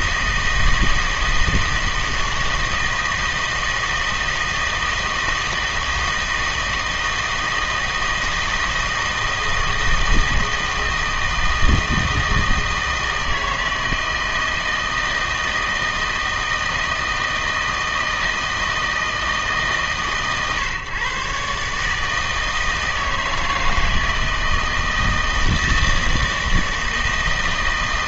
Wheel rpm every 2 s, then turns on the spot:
160, 160, 160, 160, 160, 160, 160, 160, 160, 160, 130, 160, 160, 160.
none